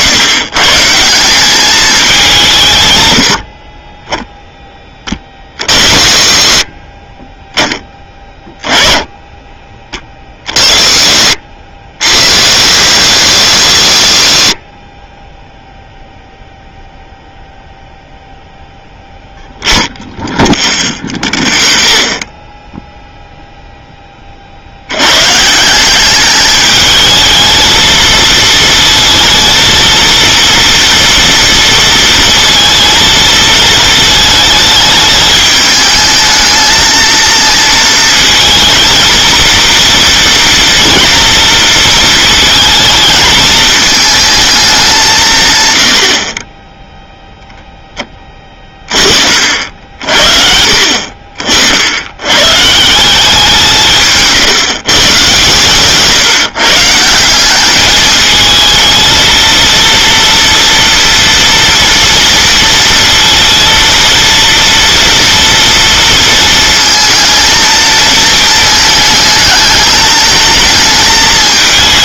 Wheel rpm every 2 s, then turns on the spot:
150, 180, 10, 40, 20, 30, 80, 50, 0, 0, 0, 0, 40, 210, 230, 230, 230, 220, 220, 230, 230, 220, 220, 30, 20, 60, 100, 150, 150, 220, 230, 230, 230, 230, 220, 220.
none